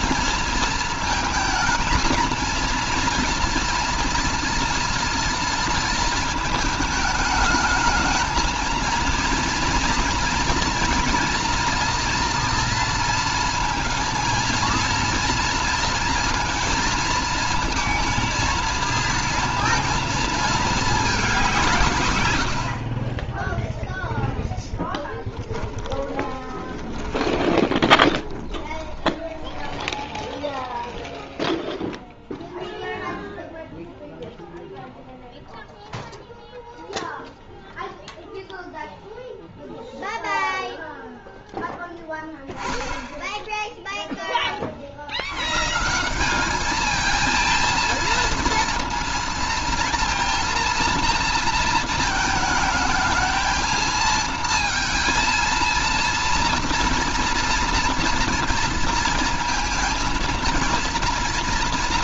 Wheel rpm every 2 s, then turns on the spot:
230, 230, 230, 220, 230, 230, 230, 220, 230, 230, 210, 50, 10, 20, 10, 0, 0, 0, 0, 0, 0, 0, 60, 220, 230, 230, 220, 230, 230, 230, 230.
24-30